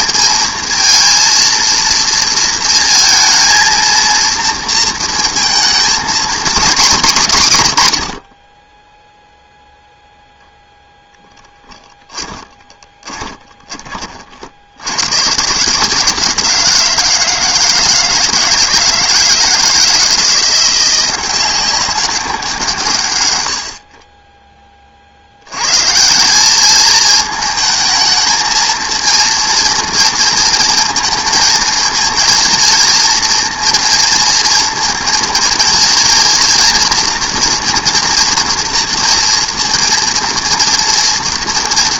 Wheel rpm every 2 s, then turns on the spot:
220, 230, 230, 230, 60, 0, 10, 30, 150, 160, 170, 190, 40, 120, 220, 230, 230, 230, 230, 230, 230.
12-14